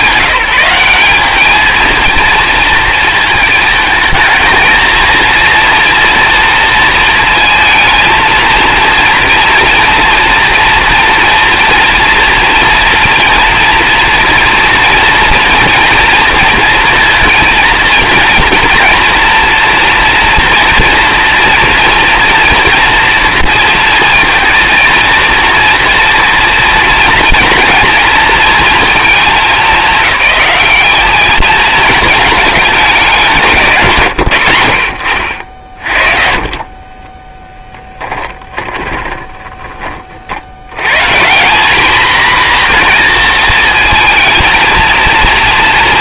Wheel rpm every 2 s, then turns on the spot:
150, 220, 220, 230, 230, 240, 230, 230, 230, 230, 230, 230, 230, 240, 230, 210, 210, 50, 30, 20, 90, 240, 220.
36-40